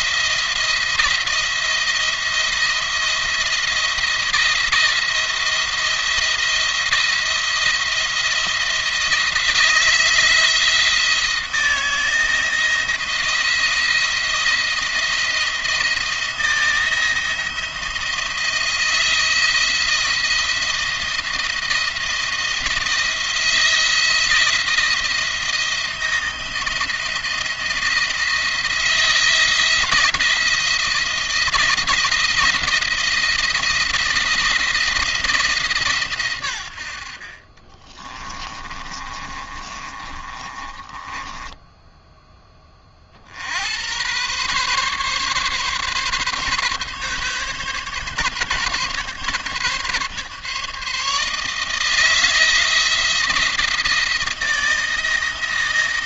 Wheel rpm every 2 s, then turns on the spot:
170, 170, 170, 170, 170, 170, 170, 170, 170, 160, 170, 170, 170, 170, 170, 170, 170, 170, 100, 20, 20, 20, 130, 140, 140, 150, 160, 160.
38-42